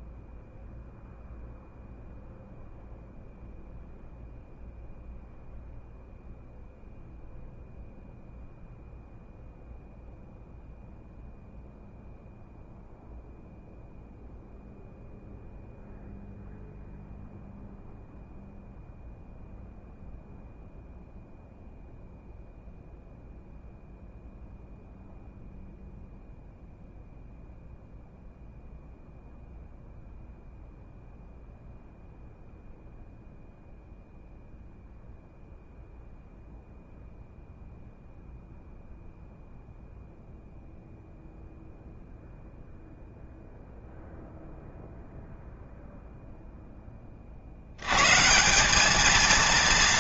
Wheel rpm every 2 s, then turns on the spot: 0, 0, 0, 0, 0, 0, 0, 0, 0, 0, 0, 0, 0, 0, 0, 0, 0, 0, 0, 0, 0, 0, 0, 30, 210.
none